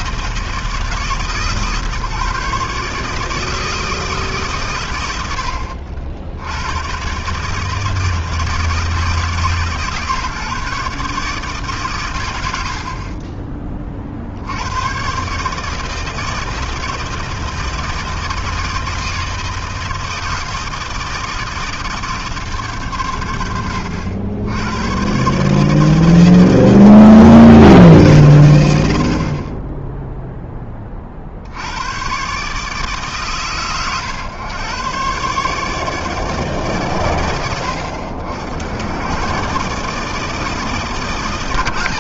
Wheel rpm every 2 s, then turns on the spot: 140, 160, 70, 160, 140, 140, 20, 150, 160, 160, 160, 90, 150, 160, 0, 80, 110, 140, 60, 130, 120.
none